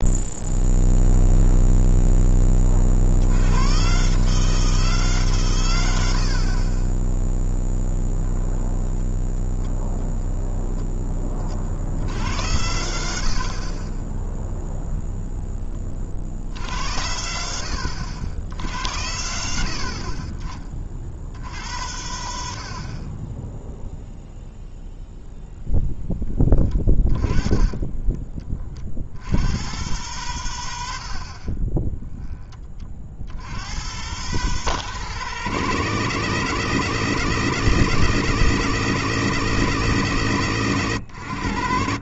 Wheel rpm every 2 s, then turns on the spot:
0, 30, 160, 20, 0, 20, 80, 0, 70, 70, 30, 60, 0, 20, 50, 90, 40, 150, 160, 160, 130.
6-8